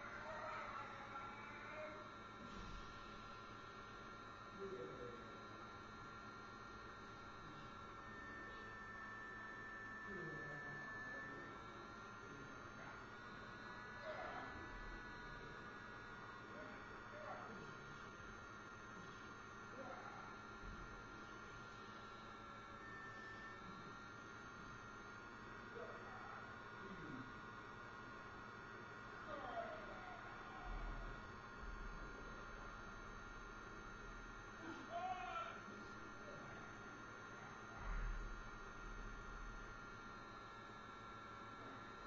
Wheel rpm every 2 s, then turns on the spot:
0, 0, 0, 0, 0, 0, 0, 0, 0, 0, 0, 0, 0, 0, 0, 0, 0, 0, 0, 0, 0.
none